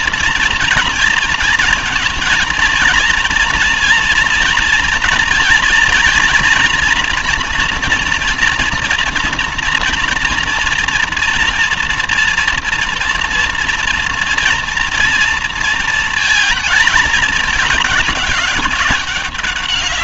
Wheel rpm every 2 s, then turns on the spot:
230, 230, 230, 240, 230, 230, 230, 230, 220, 200.
none